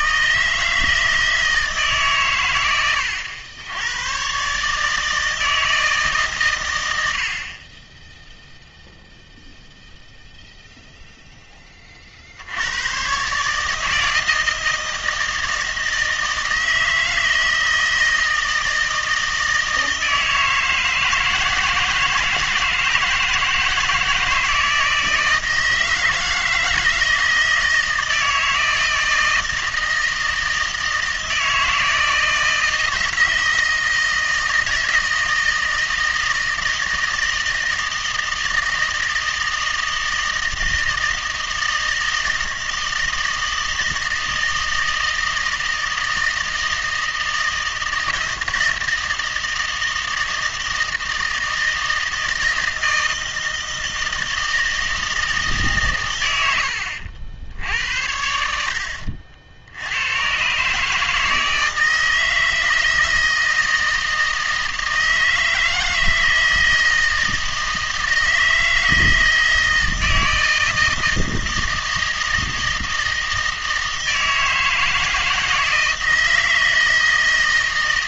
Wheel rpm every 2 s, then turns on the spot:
160, 110, 150, 110, 0, 0, 90, 160, 160, 160, 160, 160, 160, 160, 160, 160, 160, 160, 160, 160, 160, 160, 160, 160, 160, 160, 160, 160, 100, 70, 140, 160, 160, 160, 160, 160, 160, 160, 160.
none